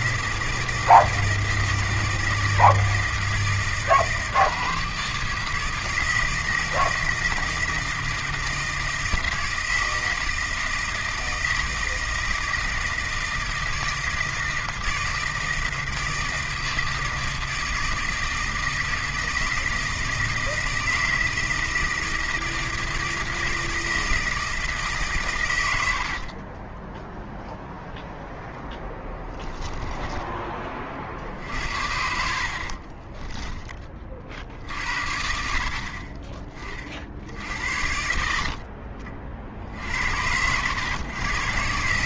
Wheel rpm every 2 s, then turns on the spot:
160, 160, 150, 160, 160, 160, 160, 160, 160, 160, 160, 160, 150, 20, 10, 30, 40, 60, 40, 30, 100.
26-30 32-34